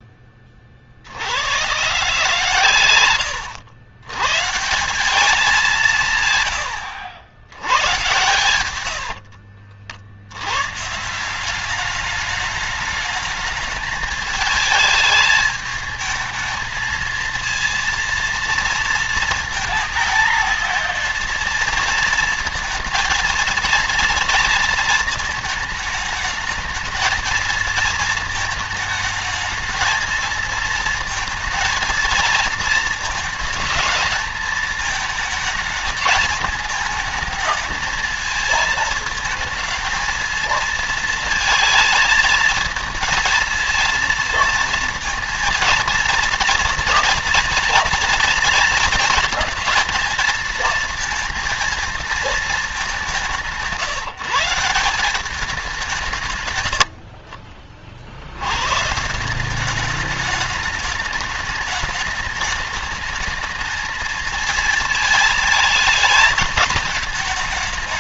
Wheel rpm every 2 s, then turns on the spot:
40, 120, 160, 100, 100, 150, 210, 220, 220, 230, 230, 230, 230, 220, 220, 220, 220, 220, 220, 220, 220, 230, 230, 240, 230, 230, 210, 180, 80, 130, 210, 210, 220, 220.
8-10